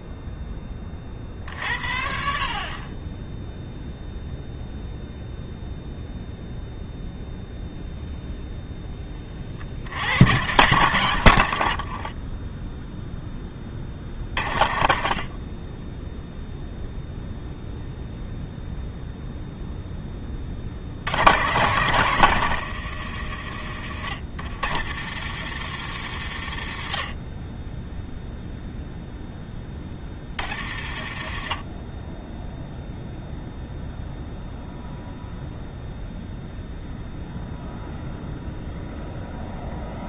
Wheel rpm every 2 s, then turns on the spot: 20, 30, 0, 0, 10, 120, 10, 50, 0, 0, 60, 100, 100, 60, 0, 70, 0, 0, 0, 0.
12-14